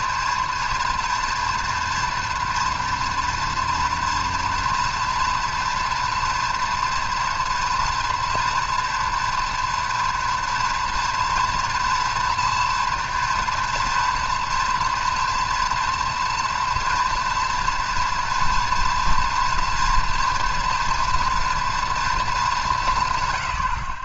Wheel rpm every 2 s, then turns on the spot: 230, 230, 240, 230, 230, 230, 230, 240, 240, 230, 230, 120.
none